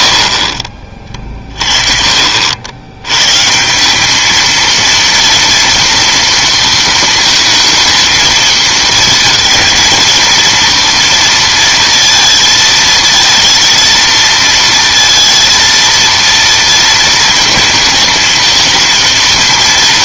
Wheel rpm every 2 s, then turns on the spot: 70, 80, 220, 230, 230, 230, 230, 230, 230, 230.
none